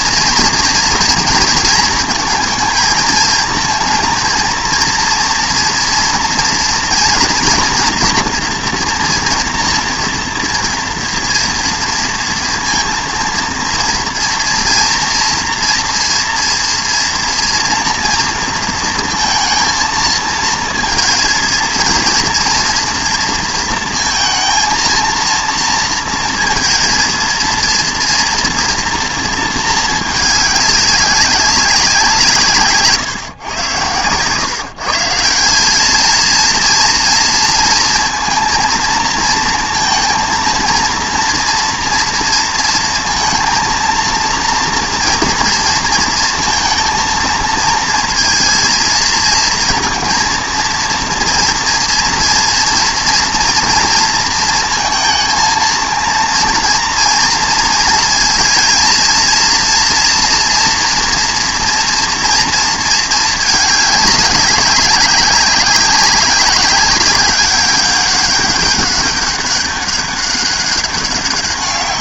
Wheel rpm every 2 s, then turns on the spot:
230, 230, 230, 230, 240, 230, 230, 230, 230, 230, 220, 230, 230, 230, 230, 210, 150, 150, 230, 230, 230, 230, 230, 230, 230, 230, 230, 230, 230, 230, 240, 230, 200, 190, 200, 200.
none